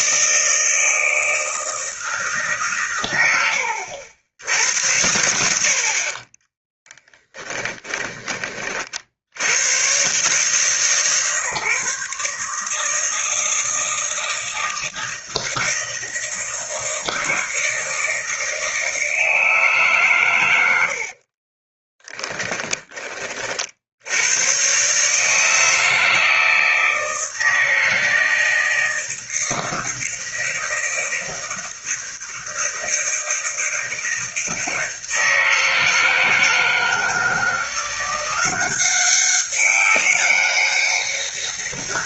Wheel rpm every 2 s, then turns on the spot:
160, 130, 80, 10, 40, 140, 160, 160, 160, 160, 80, 20, 130, 160, 160, 160, 160, 160, 160, 190, 200.
6-8